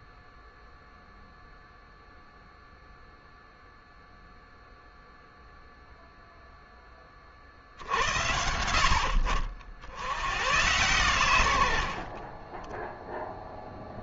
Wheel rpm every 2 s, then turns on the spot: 0, 0, 0, 20, 70, 110, 10.
none